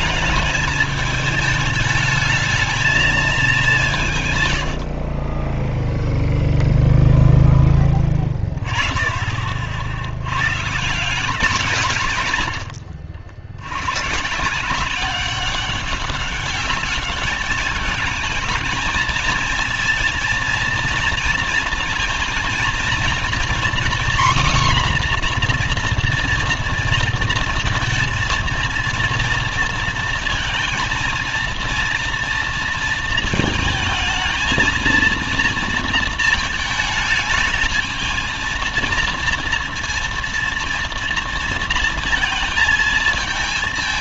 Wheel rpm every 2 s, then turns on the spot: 210, 220, 120, 0, 20, 130, 130, 160, 200, 220, 230, 230, 260, 230, 230, 230, 230, 230, 220, 220, 230, 220.
12-14